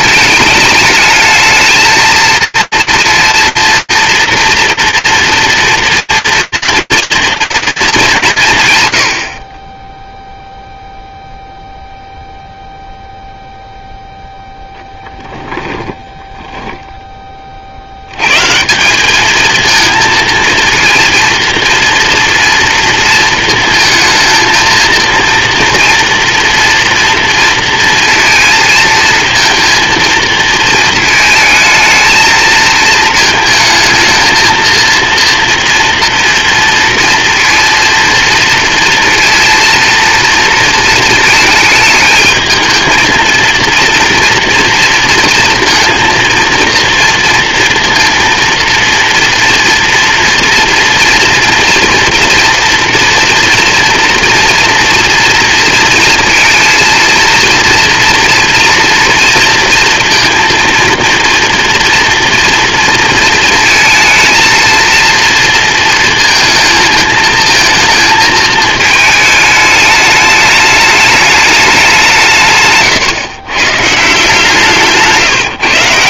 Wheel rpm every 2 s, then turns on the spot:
210, 230, 230, 230, 130, 0, 0, 20, 40, 220, 240, 230, 230, 230, 230, 220, 220, 230, 230, 230, 220, 230, 230, 230, 230, 240, 230, 230, 230, 230, 230, 230, 230, 220, 210, 210, 130, 160.
14-16